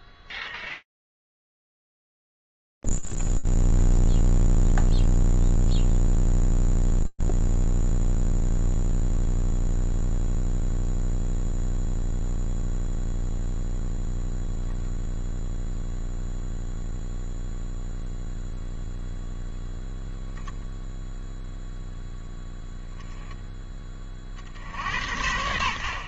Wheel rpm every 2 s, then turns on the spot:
0, 0, 0, 0, 0, 0, 0, 0, 0, 0, 0, 0, 50.
none